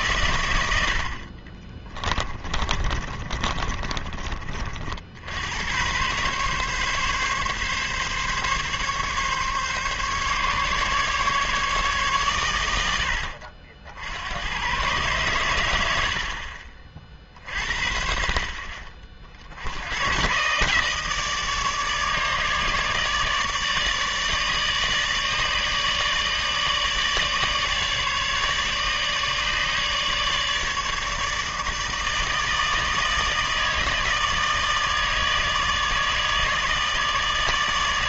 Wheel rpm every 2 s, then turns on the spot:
80, 30, 50, 140, 140, 140, 100, 110, 40, 40, 140, 150, 150, 150, 150, 150, 160, 160, 150.
2-4